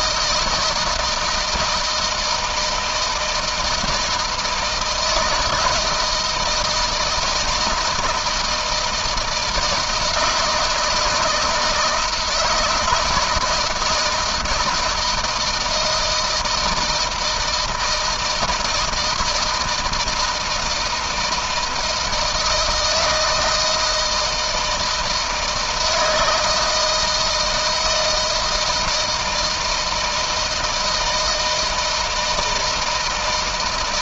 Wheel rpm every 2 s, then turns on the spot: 160, 160, 160, 170, 160, 160, 160, 160, 160, 160, 160, 160, 160, 160, 160, 160, 160.
none